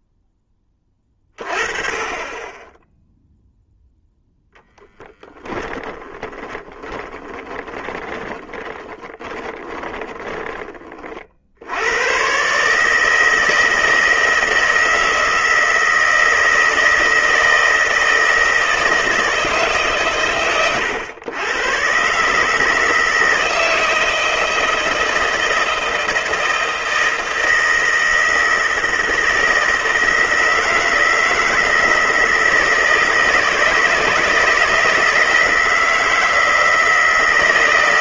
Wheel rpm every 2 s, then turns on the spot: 20, 10, 0, 10, 20, 20, 150, 160, 160, 160, 120, 160, 160, 160, 160, 160, 160, 160, 160.
6-10